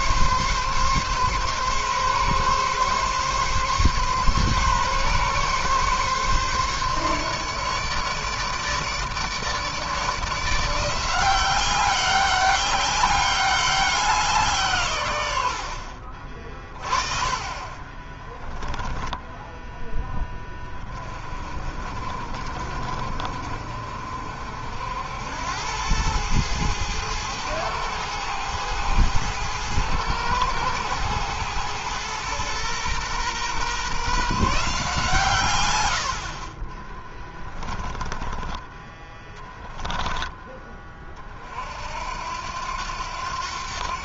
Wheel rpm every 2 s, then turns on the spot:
140, 140, 140, 140, 150, 170, 200, 130, 30, 10, 20, 50, 70, 110, 110, 110, 120, 150, 30, 20, 20, 80.
18-20 36-38